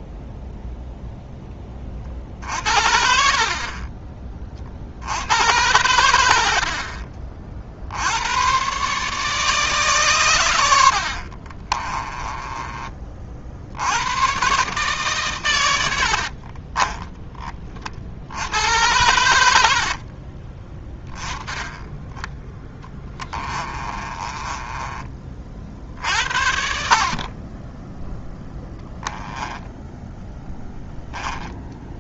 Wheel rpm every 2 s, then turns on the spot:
0, 60, 60, 50, 140, 80, 20, 140, 20, 100, 10, 10, 20, 50, 10, 10.
6-8 16-18 22-26 30-32